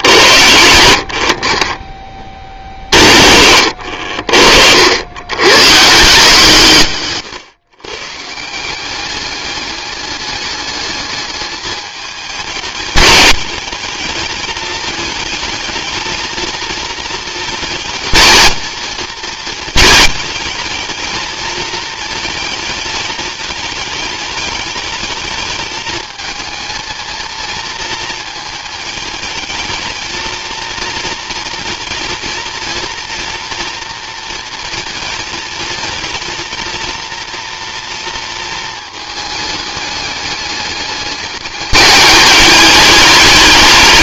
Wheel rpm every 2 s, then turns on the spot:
70, 50, 80, 140, 190, 210, 210, 220, 230, 230, 210, 220, 210, 220, 220, 230, 230, 220, 230, 220, 210, 210.
none